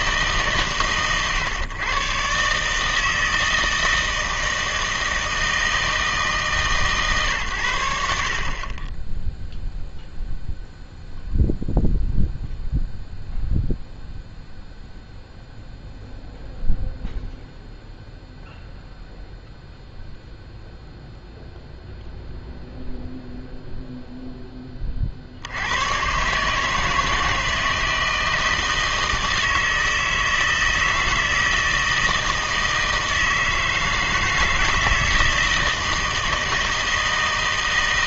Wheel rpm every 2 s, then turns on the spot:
130, 150, 160, 150, 40, 0, 0, 0, 0, 0, 0, 0, 20, 150, 160, 160, 160, 160, 160.
none